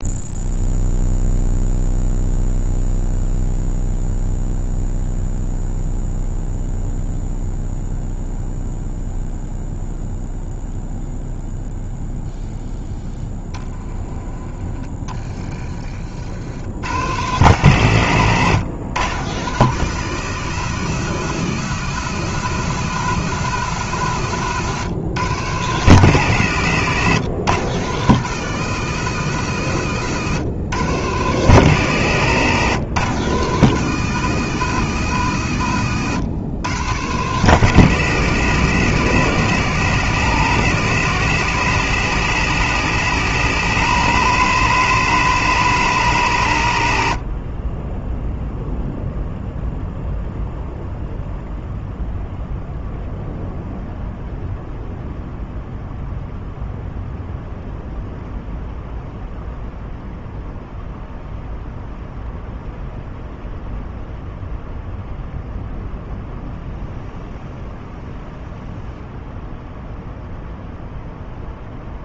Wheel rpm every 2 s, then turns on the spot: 0, 0, 0, 0, 0, 0, 0, 20, 100, 120, 130, 140, 130, 120, 140, 120, 130, 140, 120, 120, 130, 140, 150, 90, 0, 0, 0, 0, 0, 0, 0, 0, 0, 0, 0, 0.
14-16